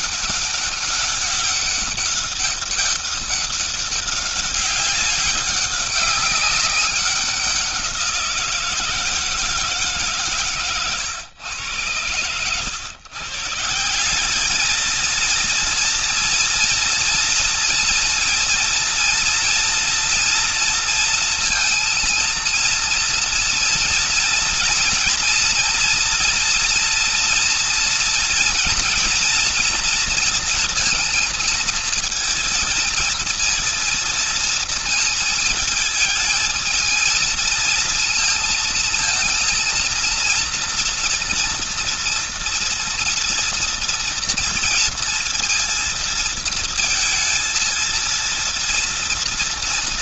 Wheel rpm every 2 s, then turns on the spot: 200, 200, 200, 190, 170, 140, 110, 190, 230, 230, 230, 230, 230, 230, 240, 230, 230, 230, 220, 230, 240, 230, 230, 230, 230.
none